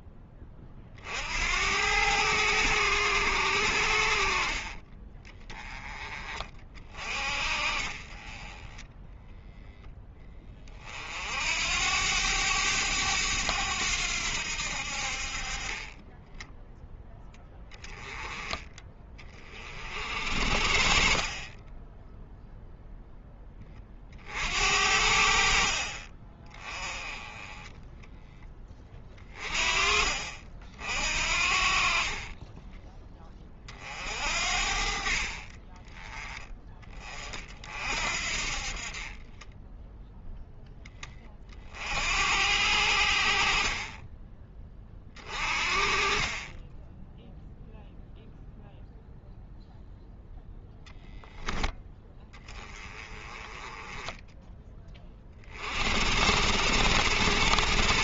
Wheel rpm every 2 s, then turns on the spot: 30, 100, 30, 40, 10, 40, 100, 70, 0, 20, 50, 0, 70, 20, 20, 50, 10, 50, 20, 40, 10, 70, 30, 10, 0, 0, 20, 10, 70.
20-22